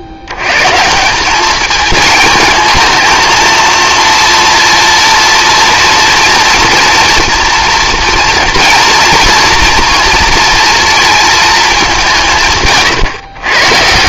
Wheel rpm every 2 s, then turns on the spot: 130, 220, 230, 230, 240, 230, 150.
12-14